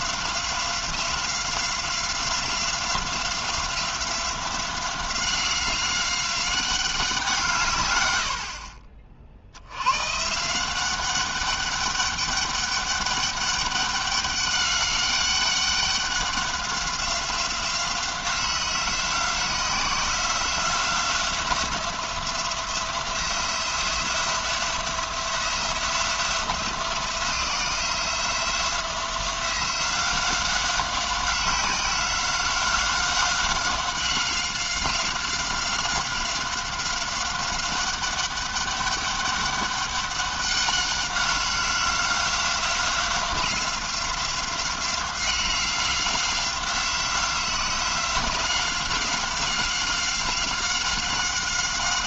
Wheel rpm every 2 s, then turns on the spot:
180, 180, 180, 190, 50, 170, 200, 200, 190, 180, 180, 170, 170, 180, 180, 190, 190, 190, 190, 200, 200, 180, 180, 190, 180, 190.
none